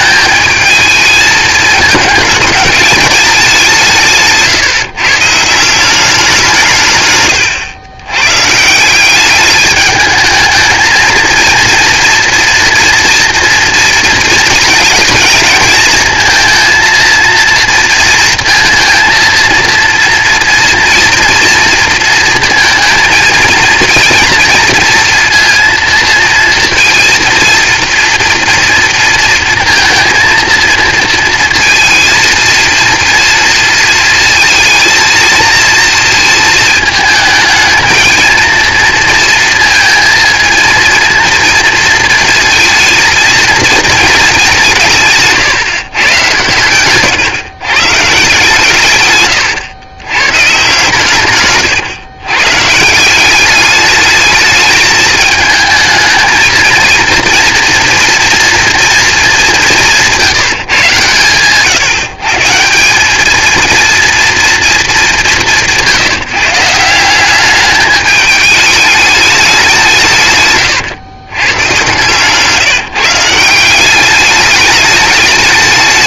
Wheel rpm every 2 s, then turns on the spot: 220, 210, 150, 140, 160, 220, 230, 220, 220, 230, 230, 230, 230, 230, 230, 230, 230, 230, 220, 230, 230, 230, 180, 130, 130, 140, 150, 220, 230, 240, 140, 180, 220, 170, 210, 120, 160, 210.
none